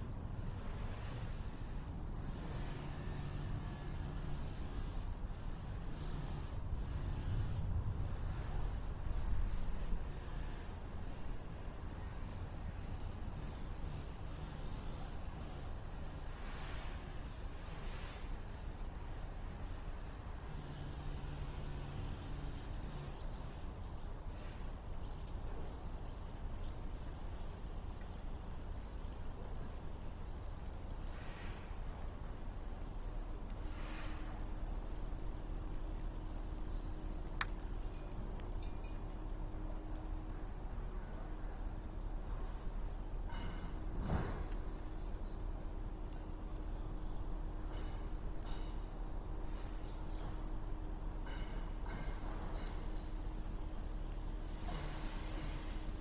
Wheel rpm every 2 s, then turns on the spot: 0, 0, 0, 0, 0, 0, 0, 0, 0, 0, 0, 0, 0, 0, 0, 0, 0, 0, 0, 0, 0, 0, 0, 0, 0, 0, 0, 0.
none